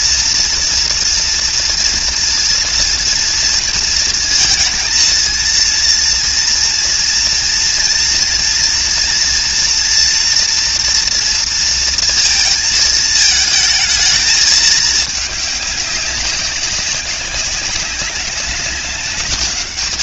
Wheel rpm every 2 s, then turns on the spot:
230, 230, 230, 230, 230, 240, 230, 220, 200, 200.
none